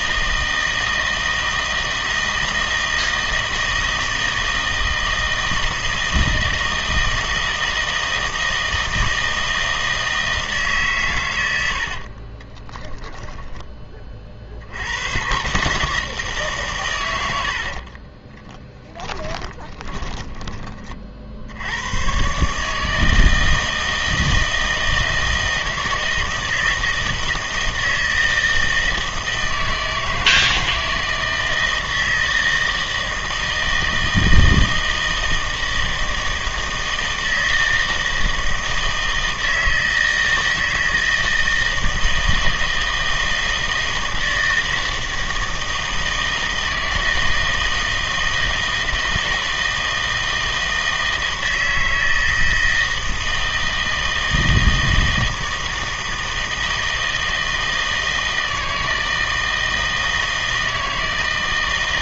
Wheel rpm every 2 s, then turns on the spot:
160, 160, 160, 160, 160, 140, 10, 70, 130, 20, 30, 150, 160, 160, 160, 160, 160, 160, 160, 160, 160, 160, 160, 160, 160, 160, 160, 160, 160, 160, 160.
12-14 18-20